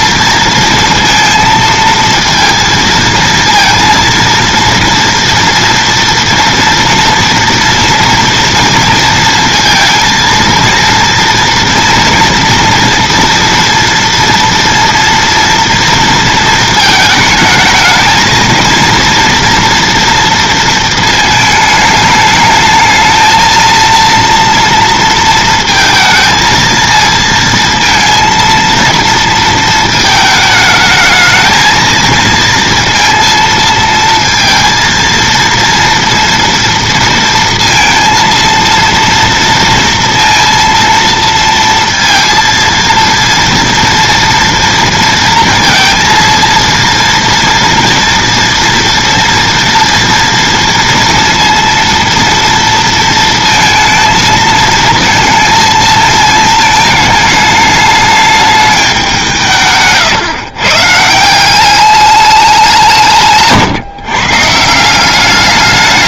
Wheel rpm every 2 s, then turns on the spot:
230, 230, 230, 230, 230, 230, 240, 230, 220, 230, 230, 220, 230, 230, 230, 220, 230, 230, 230, 230, 230, 230, 230, 230, 230, 230, 230, 220, 220, 210, 140, 190, 140.
none